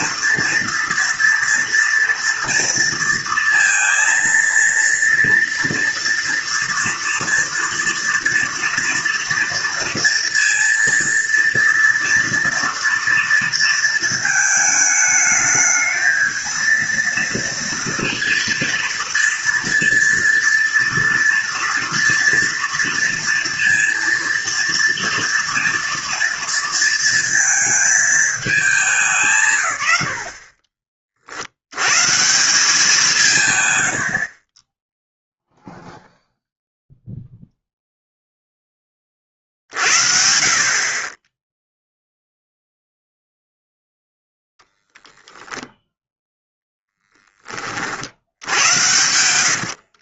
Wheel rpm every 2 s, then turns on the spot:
230, 230, 230, 230, 230, 230, 230, 220, 230, 230, 230, 230, 230, 230, 210, 40, 180, 30, 0, 10, 40, 0, 0, 0, 80.
48-50